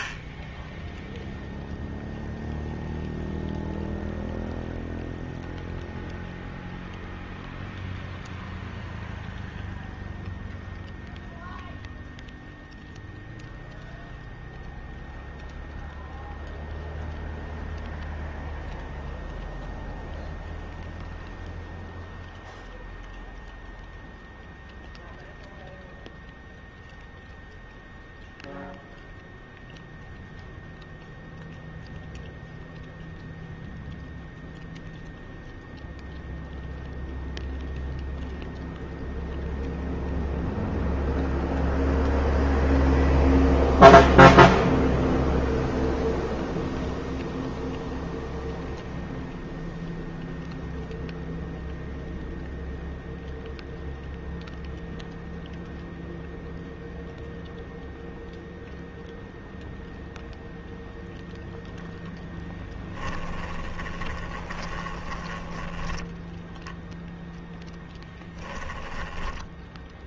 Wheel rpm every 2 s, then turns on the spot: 30, 0, 0, 0, 0, 0, 0, 0, 0, 0, 0, 0, 0, 0, 0, 0, 0, 0, 0, 0, 0, 0, 0, 0, 0, 0, 0, 0, 0, 0, 0, 10, 20, 0, 10.
0-2 64-66 68-70